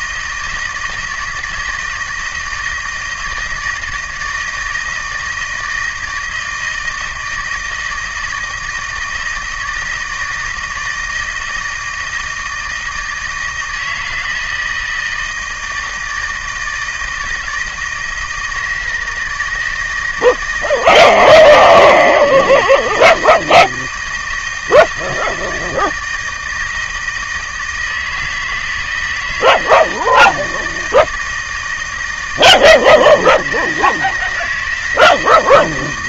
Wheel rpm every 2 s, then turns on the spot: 160, 160, 160, 160, 160, 160, 160, 160, 160, 170, 160, 160, 160, 160, 160, 160, 160, 160.
none